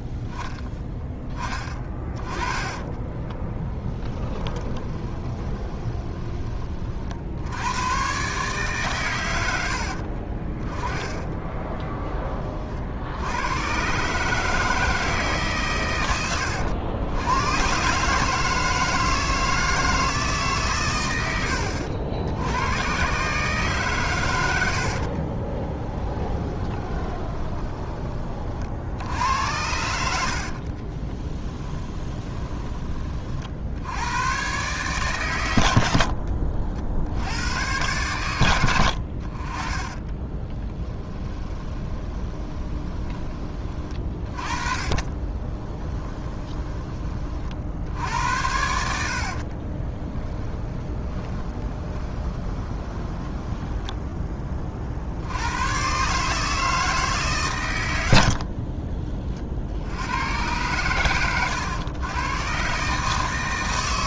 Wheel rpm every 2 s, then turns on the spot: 10, 20, 20, 40, 130, 10, 60, 160, 80, 160, 130, 110, 70, 20, 60, 40, 30, 120, 70, 80, 10, 20, 30, 20, 80, 20, 20, 50, 160, 40, 120, 130.
2-6 24-28 30-32 40-46 48-54 58-60